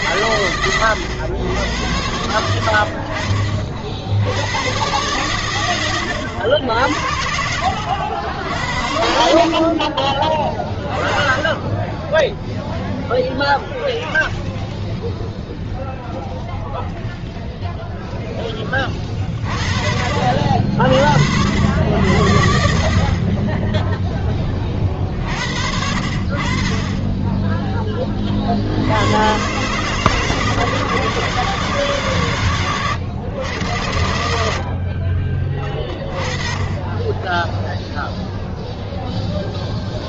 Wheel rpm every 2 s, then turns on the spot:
120, 80, 100, 80, 70, 20, 0, 0, 0, 10, 60, 60, 20, 30, 50, 160, 140, 60, 30, 0.
none